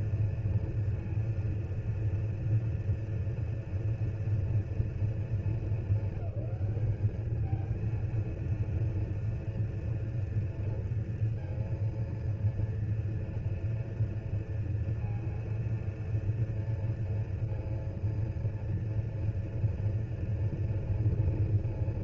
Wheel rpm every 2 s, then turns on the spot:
240, 230, 230, 200, 230, 230, 230, 230, 230, 230, 230.
none